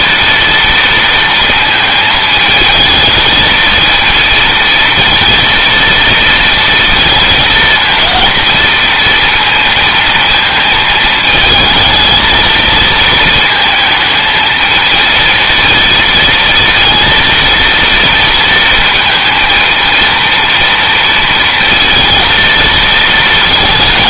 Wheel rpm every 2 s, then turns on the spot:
230, 220, 230, 230, 230, 220, 220, 230, 230, 230, 230, 220.
none